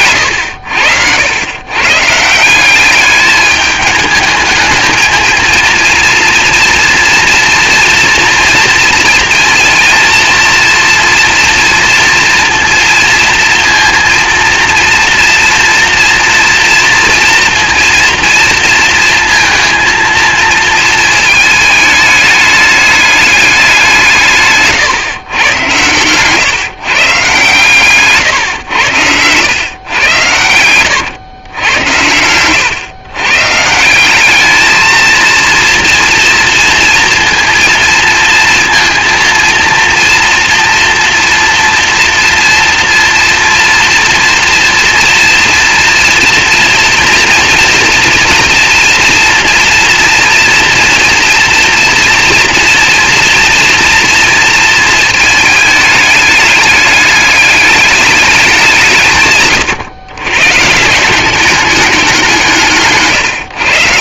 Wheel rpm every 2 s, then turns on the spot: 80, 200, 220, 230, 230, 230, 230, 230, 230, 230, 220, 210, 140, 140, 100, 110, 120, 220, 230, 230, 230, 230, 230, 240, 240, 230, 230, 220, 210, 150, 180, 140.
none